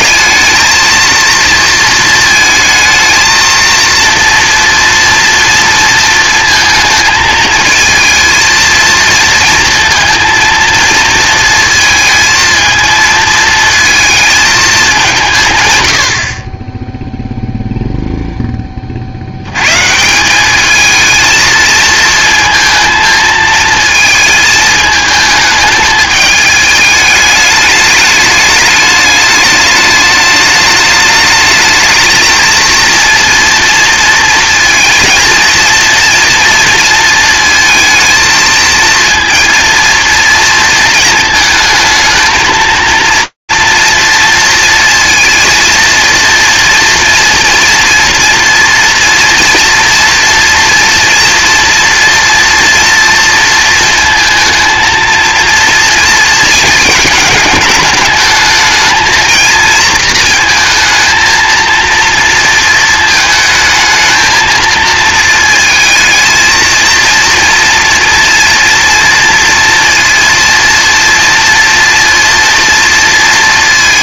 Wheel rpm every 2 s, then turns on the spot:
220, 230, 240, 220, 230, 230, 220, 190, 0, 60, 220, 220, 220, 210, 210, 210, 230, 230, 230, 230, 220, 230, 230, 230, 240, 230, 230, 230, 210, 230, 220, 220, 230, 230, 230, 230, 230.
none